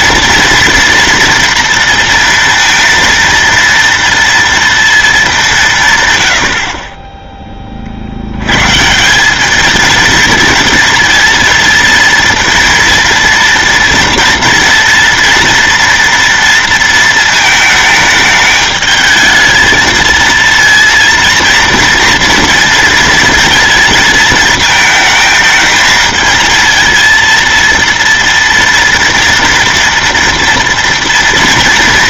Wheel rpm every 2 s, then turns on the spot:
230, 230, 230, 70, 110, 230, 230, 230, 230, 210, 230, 230, 220, 230, 230, 230.
none